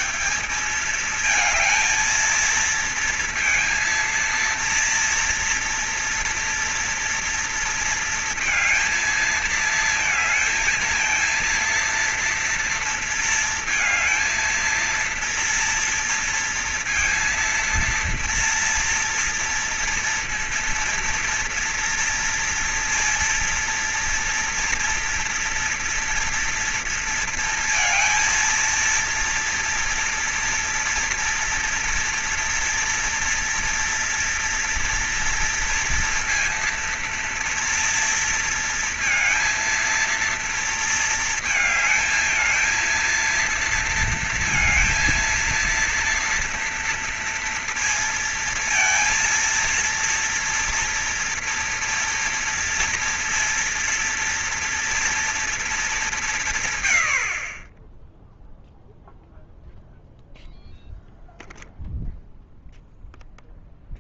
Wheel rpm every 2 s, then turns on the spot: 200, 230, 230, 230, 230, 230, 230, 230, 230, 230, 230, 230, 230, 240, 230, 230, 240, 230, 230, 230, 230, 220, 230, 230, 230, 230, 230, 230, 190, 20, 0, 0.
none